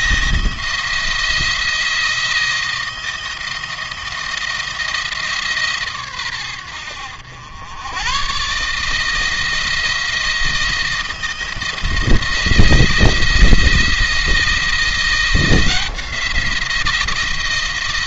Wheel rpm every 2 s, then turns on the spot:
170, 160, 160, 100, 140, 160, 170, 170, 170.
none